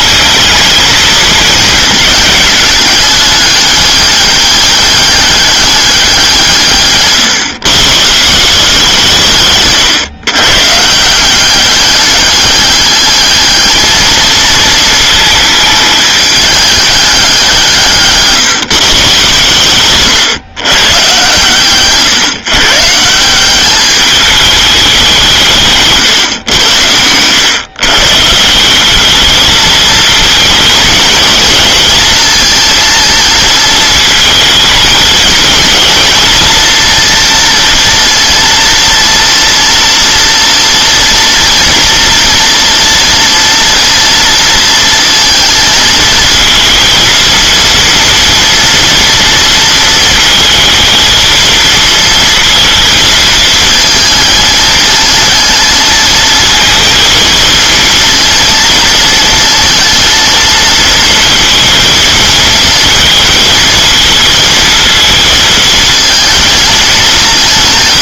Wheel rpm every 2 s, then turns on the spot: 220, 210, 200, 160, 170, 140, 210, 230, 210, 150, 130, 140, 200, 100, 180, 220, 220, 220, 230, 230, 230, 230, 230, 230, 230, 230, 230, 220, 230, 230, 230, 220, 230, 230.
none